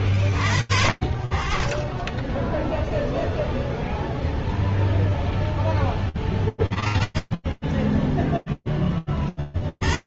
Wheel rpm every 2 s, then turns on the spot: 40, 0, 10, 20, 0.
none